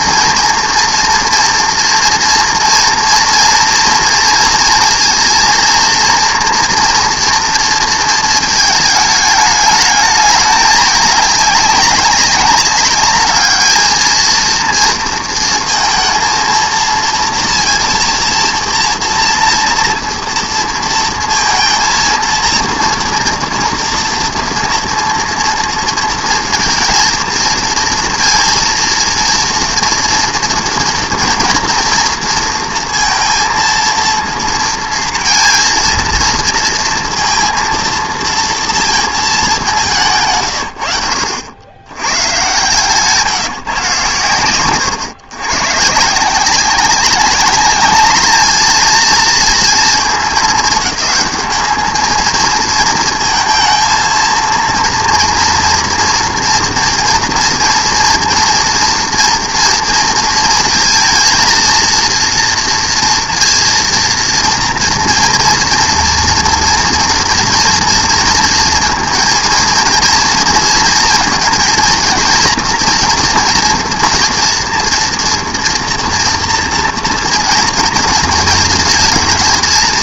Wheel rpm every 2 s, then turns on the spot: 230, 230, 230, 230, 220, 210, 200, 230, 230, 240, 230, 230, 230, 230, 230, 230, 230, 230, 230, 230, 70, 140, 110, 190, 220, 200, 230, 230, 230, 230, 230, 230, 230, 230, 230, 220, 230, 230, 230, 220.
none